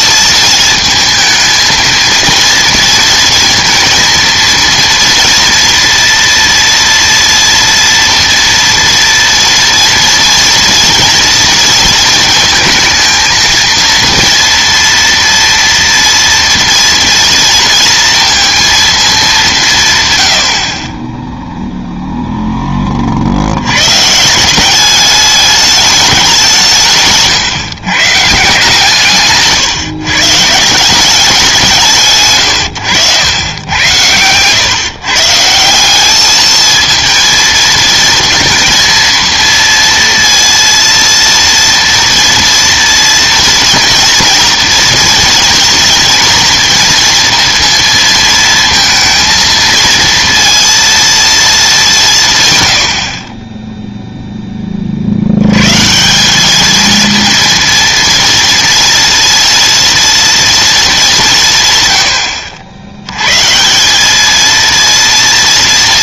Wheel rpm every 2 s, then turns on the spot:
220, 230, 230, 230, 230, 230, 220, 230, 230, 220, 30, 20, 200, 160, 150, 170, 100, 130, 220, 230, 230, 230, 230, 230, 230, 230, 100, 20, 220, 230, 220, 80, 230.
none